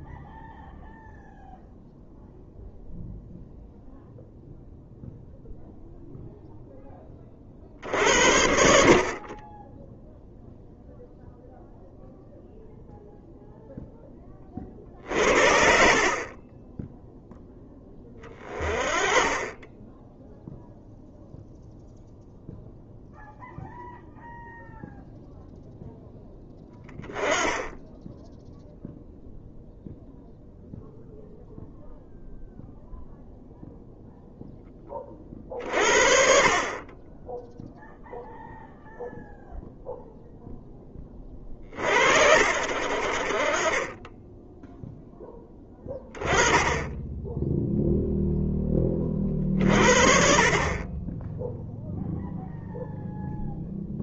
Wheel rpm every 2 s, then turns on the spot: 0, 0, 0, 10, 60, 0, 0, 40, 30, 30, 0, 0, 0, 10, 0, 0, 0, 20, 30, 0, 0, 50, 10, 20, 20, 30, 0.
none